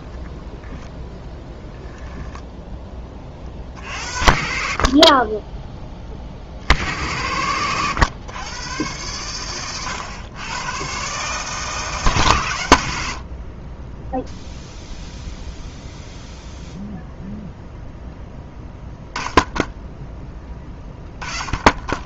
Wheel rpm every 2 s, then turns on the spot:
20, 10, 50, 50, 110, 110, 110, 0, 0, 10, 10.
none